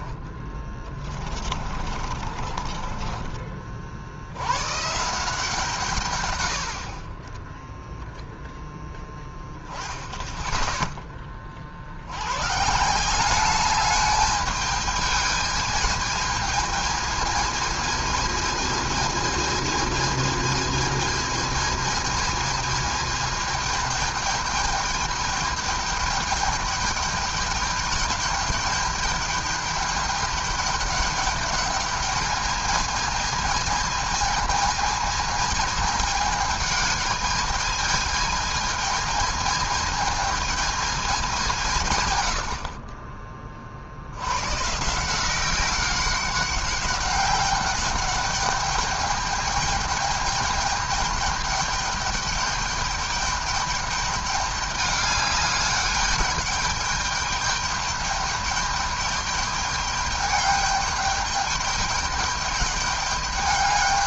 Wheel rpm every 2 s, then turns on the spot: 20, 40, 100, 100, 10, 10, 140, 210, 220, 220, 220, 220, 210, 210, 210, 210, 210, 220, 220, 220, 220, 70, 120, 190, 200, 210, 210, 210, 210, 210, 200, 210.
0-4